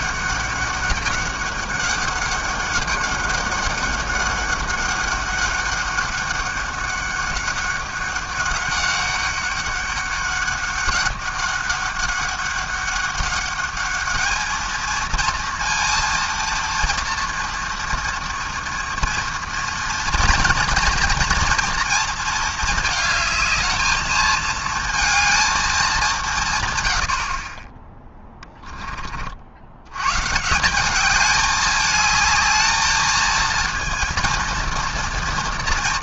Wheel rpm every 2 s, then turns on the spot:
200, 200, 200, 200, 200, 200, 200, 230, 230, 230, 240, 210, 220, 110, 20, 190, 220, 230.
none